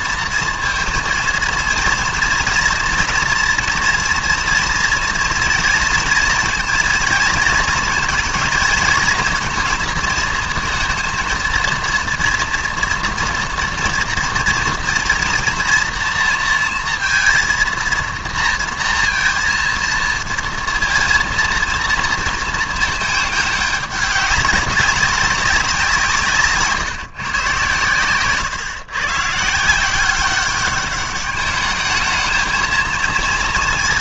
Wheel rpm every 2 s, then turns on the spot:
230, 230, 230, 240, 230, 230, 230, 230, 230, 230, 230, 220, 200, 150, 140, 200, 220.
26-28